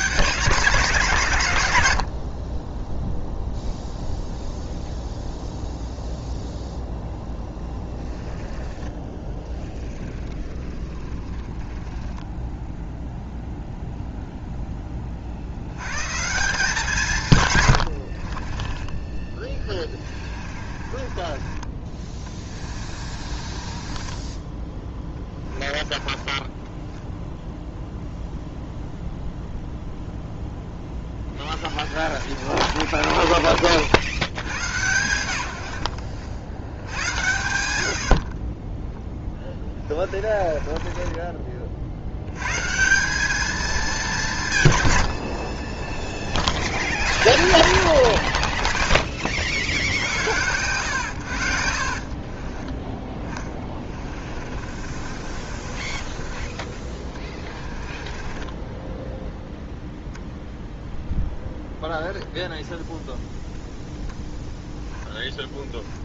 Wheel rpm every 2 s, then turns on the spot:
160, 30, 0, 0, 10, 20, 0, 10, 180, 20, 30, 30, 20, 10, 0, 10, 30, 90, 80, 20, 30, 150, 130, 70, 50, 90, 30, 40, 20, 10, 0, 0, 0.
8-12 18-24 26-28 30-34 40-42 48-50 52-56 58-60